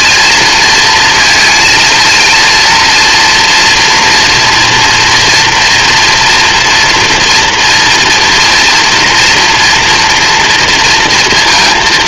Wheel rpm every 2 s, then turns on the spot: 230, 230, 240, 240, 230, 230.
none